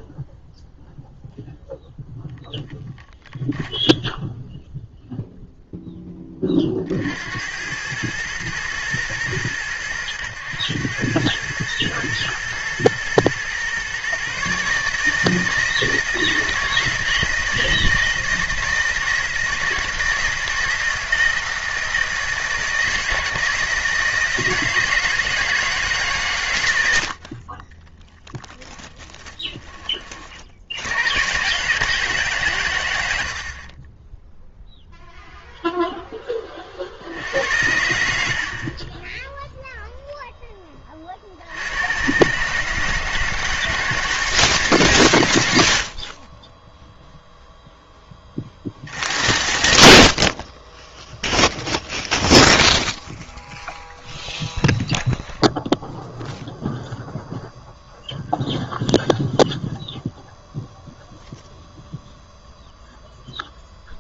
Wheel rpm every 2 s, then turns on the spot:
0, 0, 0, 50, 110, 100, 110, 150, 160, 160, 160, 160, 160, 80, 20, 90, 110, 0, 50, 40, 40, 160, 130, 10, 50, 10, 0, 0, 0, 0, 0, 0.
28-30